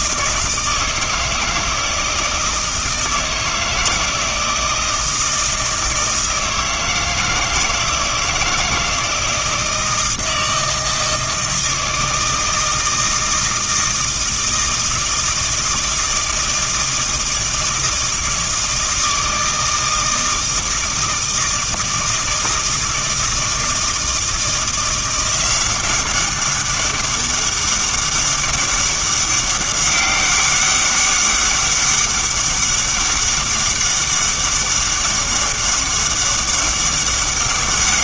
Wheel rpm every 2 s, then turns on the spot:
160, 160, 160, 160, 160, 160, 160, 160, 160, 160, 160, 160, 170, 200, 200, 200, 200, 200, 200.
none